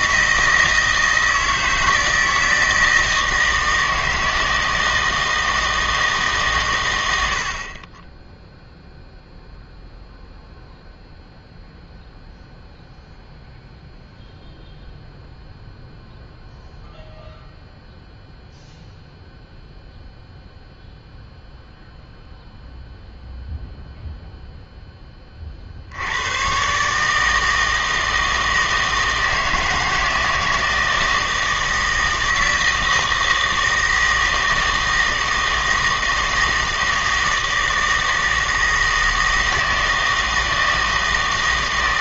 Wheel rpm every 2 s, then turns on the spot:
160, 160, 160, 120, 0, 0, 0, 0, 0, 0, 0, 0, 0, 130, 160, 160, 160, 160, 160, 160, 160.
none